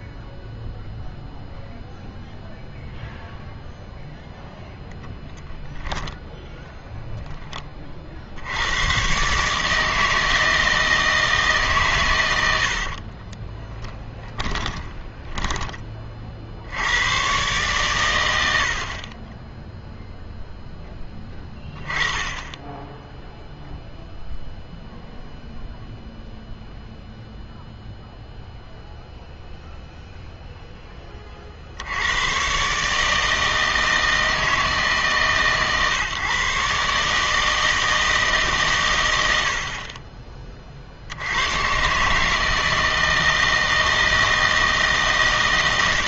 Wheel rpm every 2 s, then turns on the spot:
0, 0, 10, 10, 90, 160, 80, 20, 60, 80, 10, 20, 0, 0, 0, 0, 130, 160, 140, 140, 30, 160, 160.
6-8 12-16